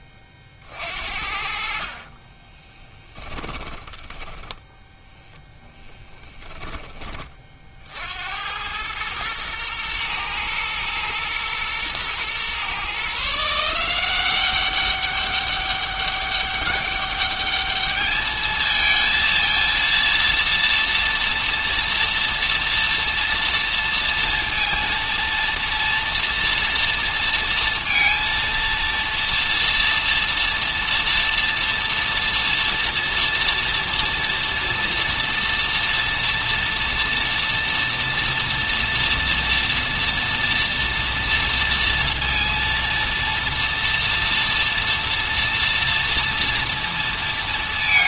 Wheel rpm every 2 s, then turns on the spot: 50, 20, 10, 20, 90, 120, 130, 200, 200, 220, 230, 240, 230, 230, 230, 240, 230, 230, 230, 230, 230, 230, 230, 230.
2-4